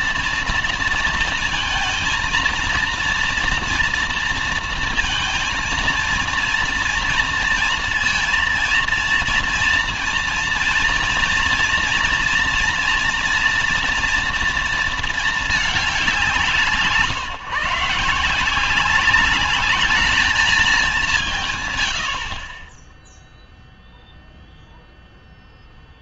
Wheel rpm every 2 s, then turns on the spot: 230, 230, 230, 230, 230, 230, 240, 230, 170, 170, 220, 40, 0.
none